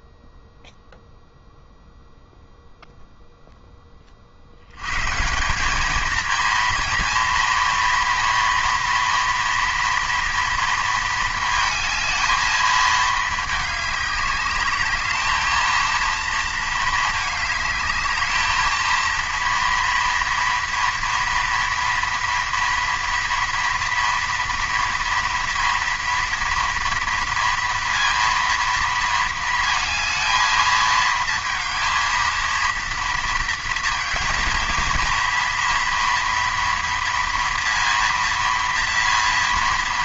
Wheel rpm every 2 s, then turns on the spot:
0, 0, 100, 230, 230, 230, 220, 200, 230, 220, 230, 230, 230, 230, 230, 220, 230, 230, 230, 230.
none